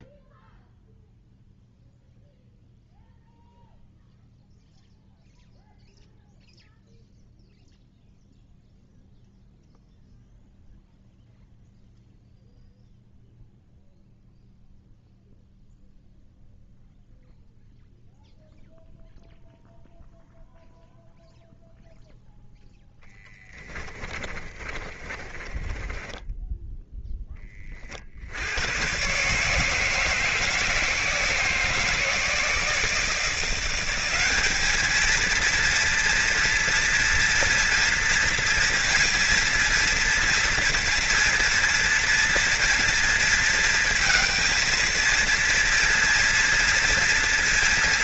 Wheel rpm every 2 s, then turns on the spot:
0, 0, 0, 0, 0, 0, 0, 0, 0, 0, 0, 10, 20, 10, 130, 160, 170, 220, 240, 230, 230, 230, 230, 230.
24-26